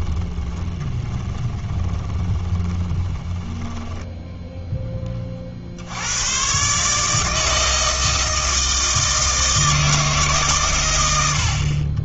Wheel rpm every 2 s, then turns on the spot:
20, 20, 10, 140, 160, 130.
0-4